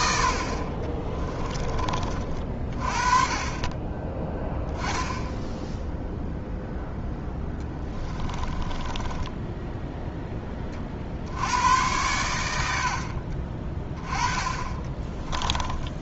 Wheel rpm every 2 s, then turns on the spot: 30, 40, 10, 0, 20, 40, 90, 20.
0-2 8-10 14-16